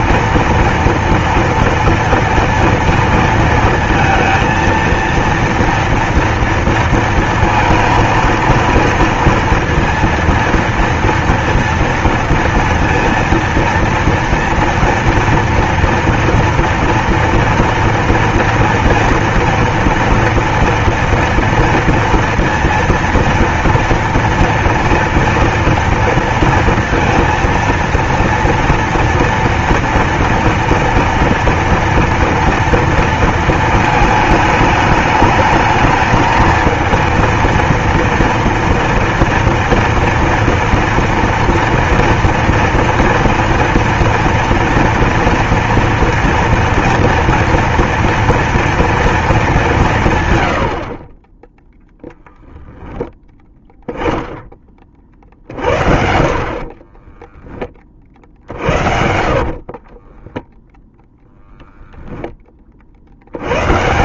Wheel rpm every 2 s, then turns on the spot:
230, 230, 230, 230, 230, 230, 230, 230, 230, 230, 230, 230, 230, 230, 230, 230, 230, 210, 220, 230, 230, 230, 230, 230, 230, 70, 10, 20, 30, 60, 10, 30.
56-60